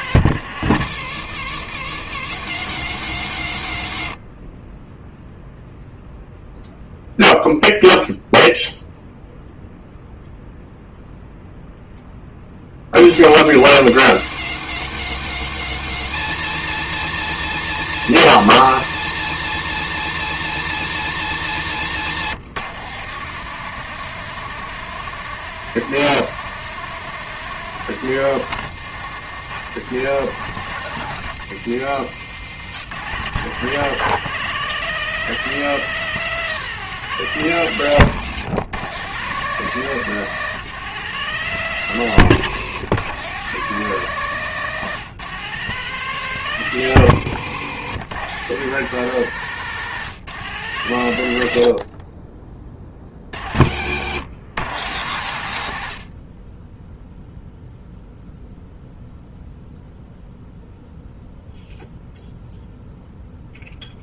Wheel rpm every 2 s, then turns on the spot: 100, 90, 10, 0, 0, 0, 50, 100, 120, 120, 120, 140, 170, 170, 150, 150, 130, 170, 170, 130, 150, 120, 150, 110, 140, 110, 40, 110, 0, 0, 0, 0.
none